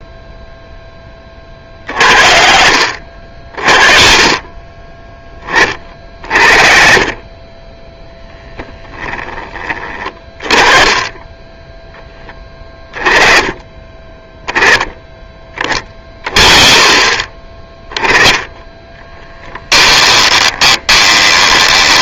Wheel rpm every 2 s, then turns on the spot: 10, 40, 10, 20, 10, 10, 10, 10, 30, 10, 20.
18-22